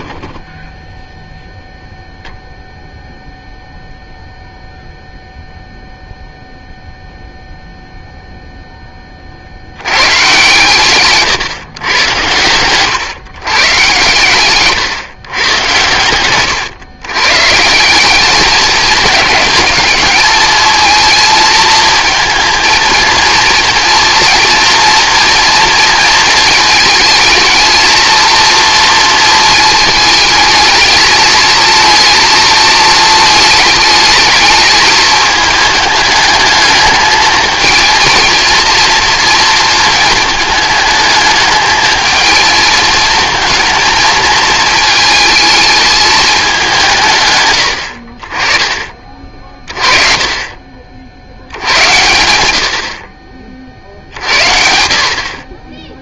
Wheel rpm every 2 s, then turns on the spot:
0, 0, 0, 0, 10, 130, 110, 130, 120, 210, 230, 230, 230, 220, 230, 220, 230, 220, 220, 230, 220, 220, 220, 170, 30, 50, 70, 60.
none